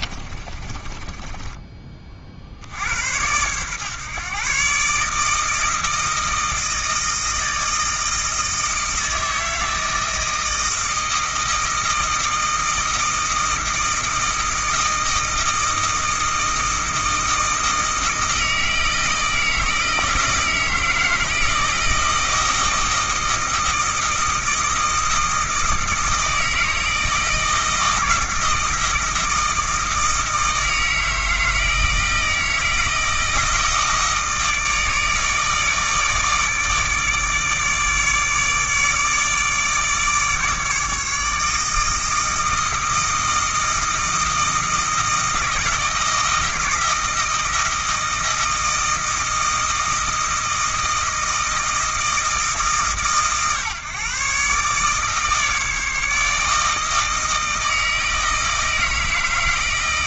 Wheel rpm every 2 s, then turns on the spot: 30, 70, 140, 160, 160, 160, 160, 160, 160, 160, 160, 160, 160, 160, 160, 160, 160, 160, 150, 150, 150, 160, 160, 160, 160, 160, 150, 140, 160, 160.
0-2